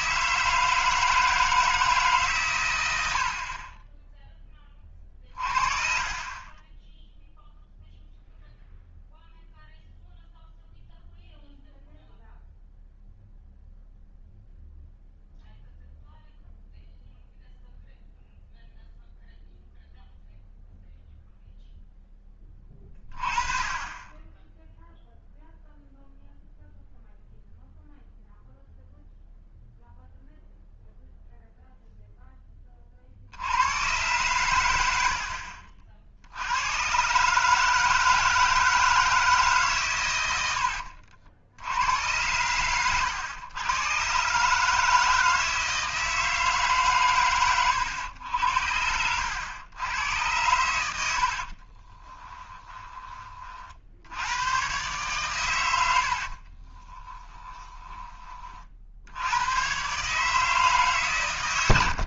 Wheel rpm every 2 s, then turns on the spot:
160, 110, 20, 20, 0, 0, 0, 0, 0, 0, 0, 20, 0, 0, 0, 0, 20, 100, 100, 160, 80, 100, 150, 150, 80, 90, 20, 120, 30, 60, 150.
40-42 48-50 56-58